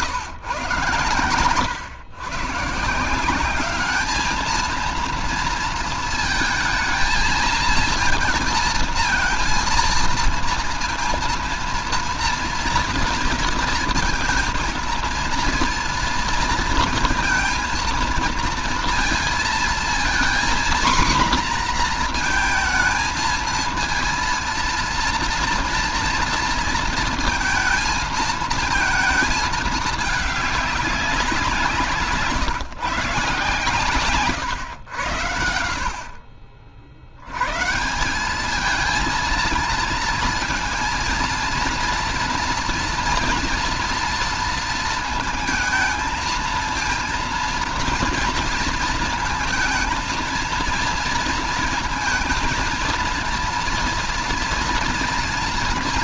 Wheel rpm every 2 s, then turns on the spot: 130, 140, 220, 220, 230, 230, 230, 230, 230, 230, 240, 230, 230, 230, 220, 210, 160, 110, 70, 220, 230, 230, 230, 230, 230, 230, 230, 230.
none